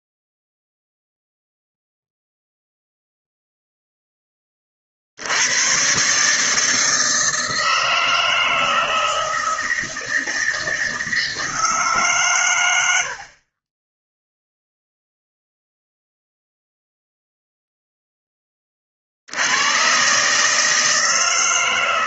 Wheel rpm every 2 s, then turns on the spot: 0, 0, 30, 160, 160, 160, 90, 0, 0, 30, 160.
none